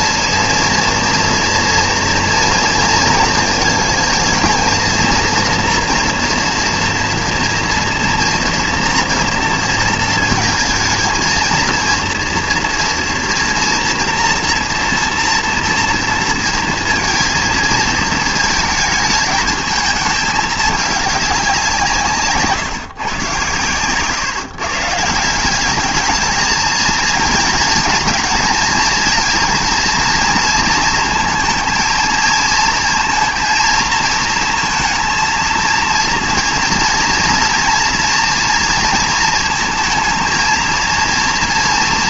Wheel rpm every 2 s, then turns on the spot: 230, 230, 230, 240, 240, 220, 230, 240, 230, 220, 210, 140, 140, 220, 220, 230, 220, 230, 240, 230, 230.
none